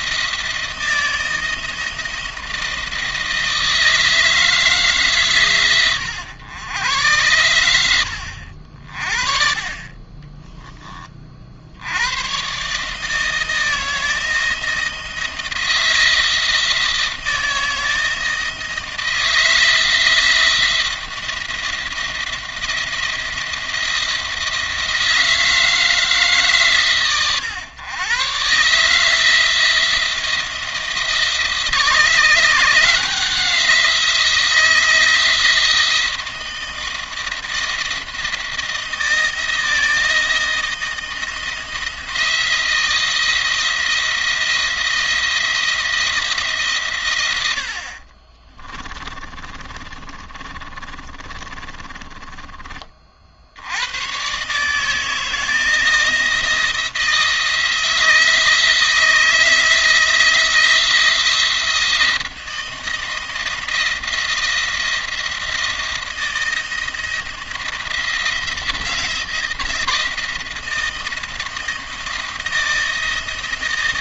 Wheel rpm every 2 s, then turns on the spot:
160, 160, 150, 110, 60, 30, 150, 170, 160, 160, 170, 170, 160, 130, 150, 160, 170, 170, 160, 160, 170, 170, 170, 120, 20, 30, 40, 160, 160, 160, 170, 160, 170, 170, 170, 170, 160.
48-52